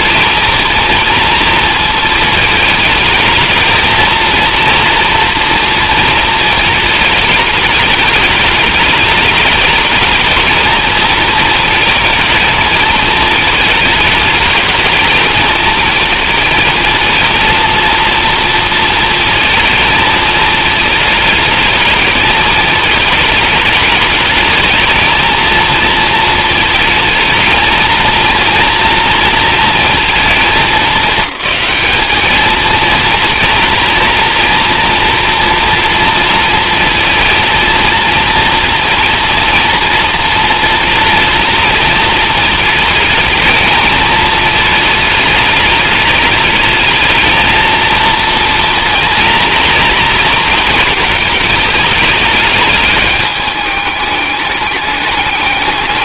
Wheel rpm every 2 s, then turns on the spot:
230, 220, 230, 210, 210, 220, 220, 210, 230, 230, 220, 220, 230, 220, 230, 210, 230, 230, 230, 230, 230, 220, 210, 220, 230, 230, 210, 210.
none